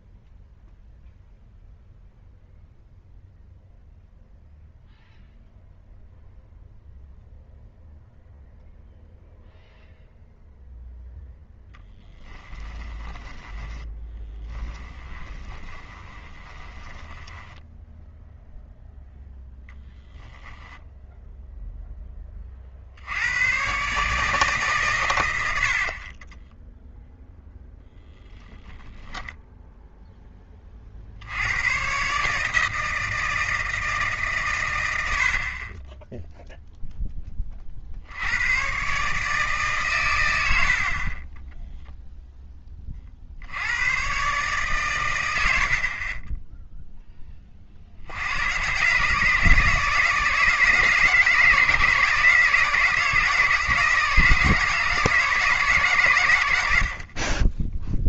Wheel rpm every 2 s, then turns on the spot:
0, 0, 0, 0, 0, 0, 10, 10, 20, 0, 0, 50, 150, 10, 0, 30, 160, 110, 0, 120, 60, 20, 130, 10, 110, 150, 160, 160, 80.
12-18 26-28